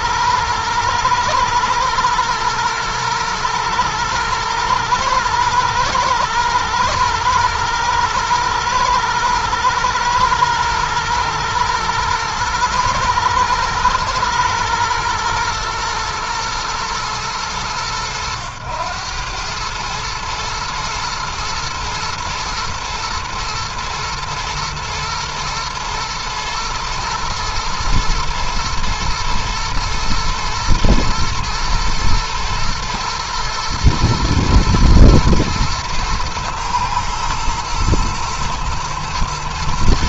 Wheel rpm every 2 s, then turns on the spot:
110, 110, 110, 110, 120, 110, 110, 110, 100, 100, 120, 110, 120, 120, 110, 120, 120, 120, 110, 110.
none